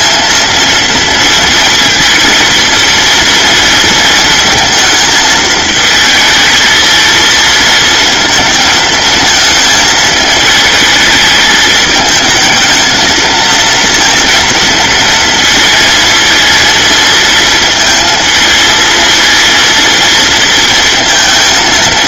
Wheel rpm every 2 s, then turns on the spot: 230, 230, 220, 220, 220, 210, 220, 230, 230, 230, 230.
none